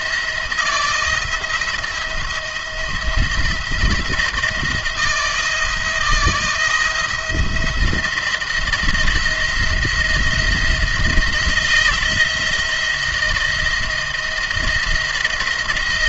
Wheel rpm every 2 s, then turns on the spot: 170, 170, 170, 170, 170, 170, 170, 170.
none